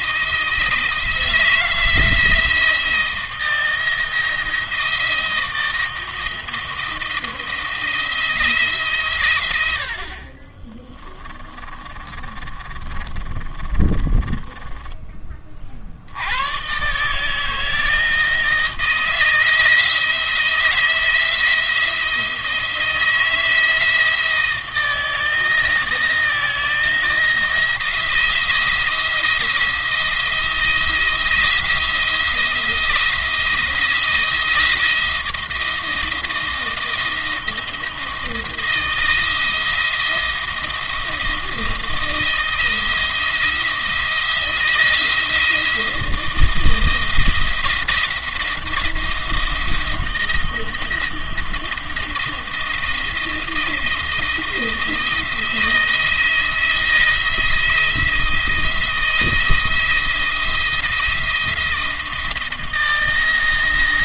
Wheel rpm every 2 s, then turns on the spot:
170, 170, 160, 170, 130, 30, 30, 20, 150, 160, 170, 160, 160, 160, 170, 160, 170, 170, 170, 170, 170, 170, 170, 160, 170, 170, 170, 170, 170, 170, 170, 160.
10-14